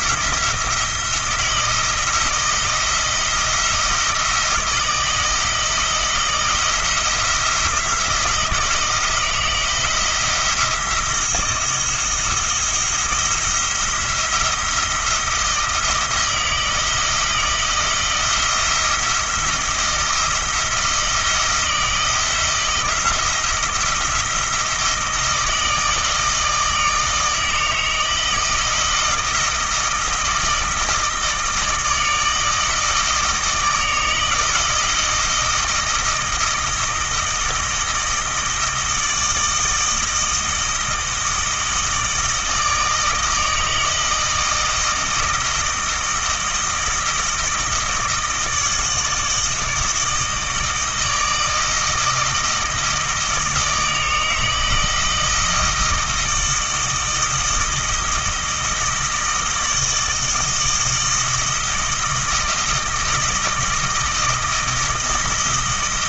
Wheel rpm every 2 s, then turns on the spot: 160, 170, 170, 170, 160, 170, 170, 170, 160, 170, 160, 170, 160, 160, 160, 160, 160, 160, 160, 160, 160, 160, 160, 160, 160, 160, 160, 160, 160, 160, 160, 160, 160.
none